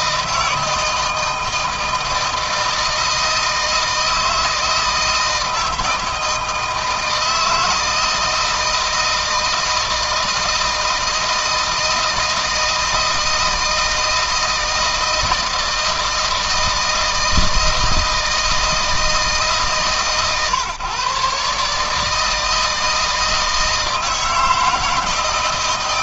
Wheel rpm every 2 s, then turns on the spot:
160, 160, 160, 160, 160, 160, 160, 160, 160, 160, 130, 160, 160.
none